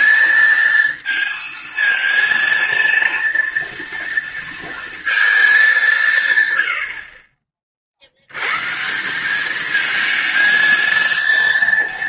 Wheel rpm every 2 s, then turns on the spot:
230, 230, 230, 110, 130, 230.
none